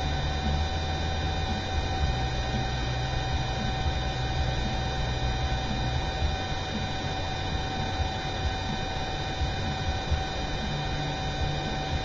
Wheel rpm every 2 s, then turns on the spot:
0, 0, 0, 0, 0, 0.
none